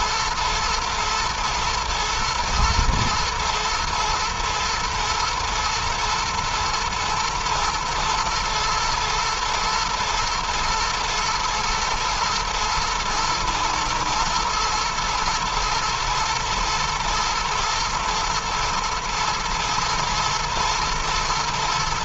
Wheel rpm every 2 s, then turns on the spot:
120, 120, 120, 120, 110, 110, 110, 120, 120, 120, 110.
none